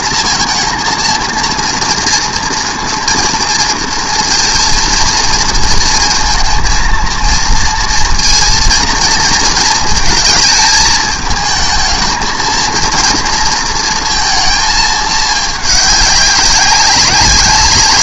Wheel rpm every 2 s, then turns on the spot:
230, 230, 230, 230, 220, 220, 230, 200, 190.
none